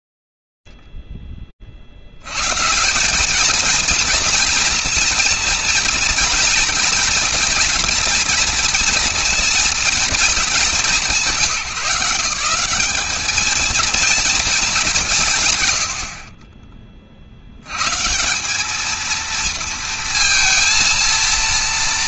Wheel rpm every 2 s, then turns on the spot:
0, 140, 230, 230, 240, 210, 190, 210, 40, 200, 230.
16-18